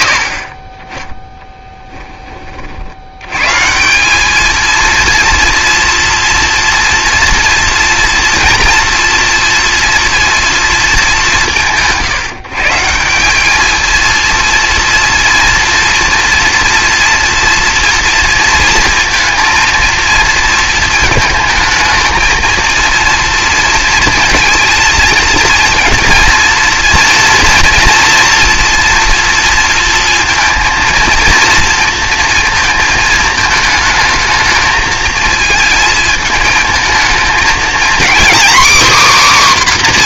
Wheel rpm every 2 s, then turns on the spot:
30, 60, 230, 230, 230, 200, 140, 230, 230, 230, 220, 230, 230, 230, 230, 230, 220, 220, 230, 270.
none